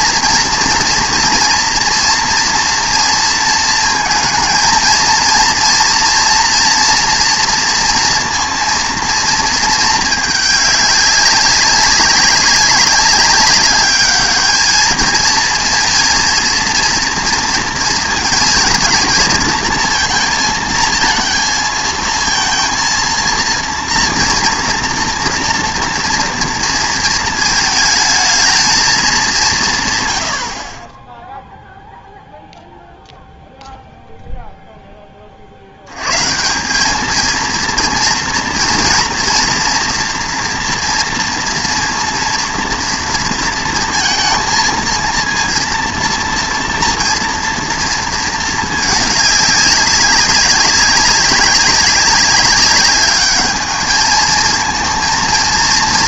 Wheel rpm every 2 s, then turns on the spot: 230, 230, 230, 230, 230, 210, 200, 210, 230, 220, 220, 230, 240, 230, 220, 50, 0, 0, 180, 230, 230, 230, 230, 230, 220, 200, 200, 220.
none